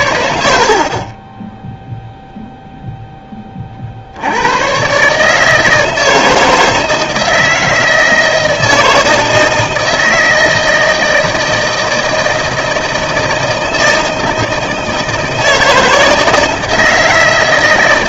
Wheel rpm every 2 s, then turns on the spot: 70, 0, 120, 160, 160, 160, 160, 160, 160.
none